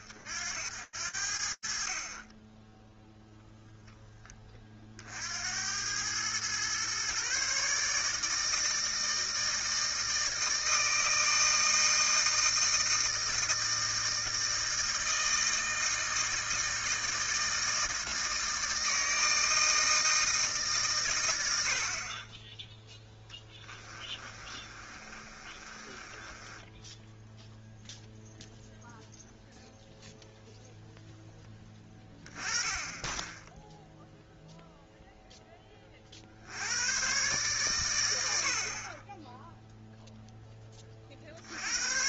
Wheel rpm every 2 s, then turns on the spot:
60, 20, 30, 120, 160, 160, 160, 160, 160, 160, 120, 10, 30, 10, 0, 0, 20, 0, 120, 20, 30.
22-28